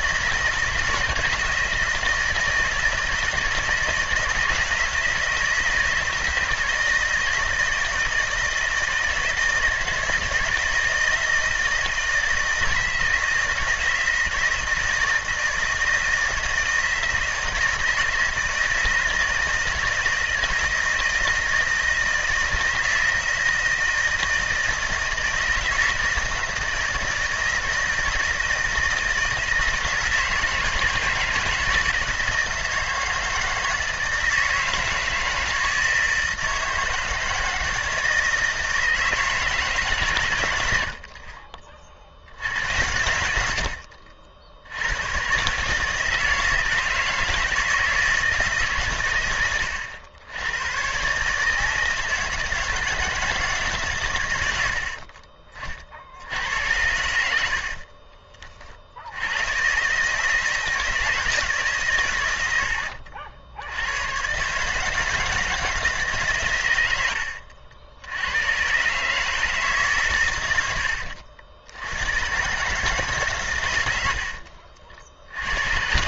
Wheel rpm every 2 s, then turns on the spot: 160, 160, 160, 160, 160, 160, 160, 170, 160, 160, 160, 160, 160, 160, 160, 160, 160, 160, 160, 160, 90, 80, 80, 160, 150, 110, 160, 80, 80, 40, 160, 90, 140, 100, 130, 90, 140, 60.
74-76